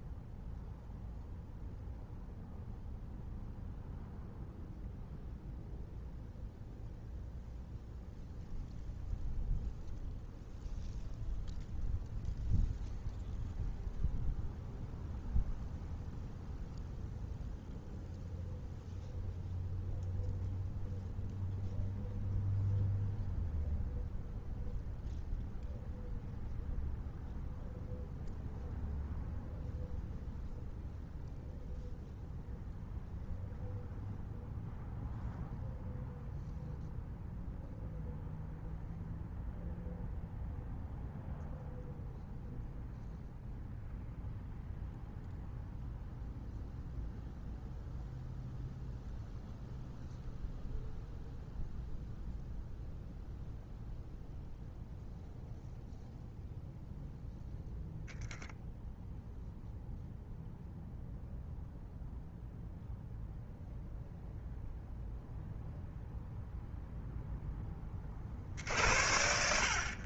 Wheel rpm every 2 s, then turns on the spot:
0, 0, 0, 0, 0, 0, 0, 0, 0, 0, 0, 0, 0, 0, 0, 0, 0, 0, 0, 0, 0, 0, 0, 0, 0, 0, 0, 0, 0, 0, 0, 0, 0, 0, 60.
none